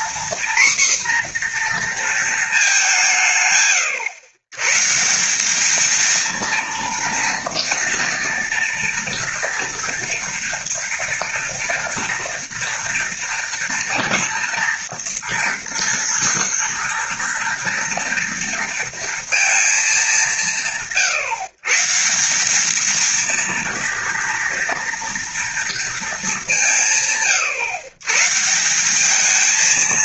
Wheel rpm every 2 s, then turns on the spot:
250, 180, 160, 230, 230, 230, 230, 240, 230, 230, 160, 230, 230, 150, 190.
none